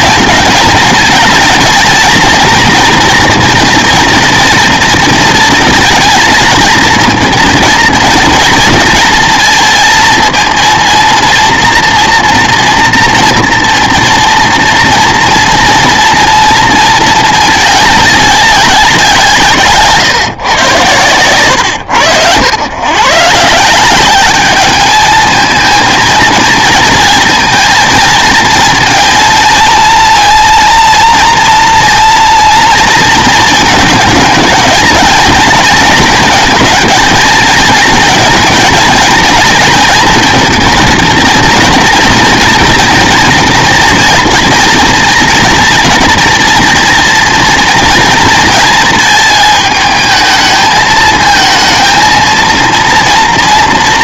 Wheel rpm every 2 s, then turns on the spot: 220, 230, 230, 220, 230, 230, 230, 230, 230, 190, 130, 120, 210, 230, 230, 230, 230, 220, 230, 220, 230, 230, 230, 230, 220, 220, 230.
none